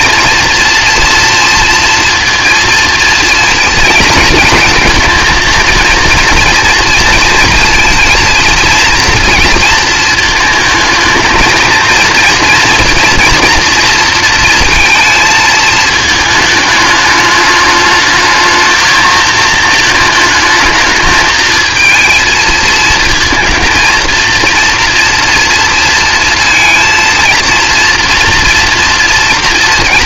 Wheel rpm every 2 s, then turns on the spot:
230, 230, 220, 230, 230, 220, 230, 230, 210, 220, 220, 220, 230, 230, 240.
none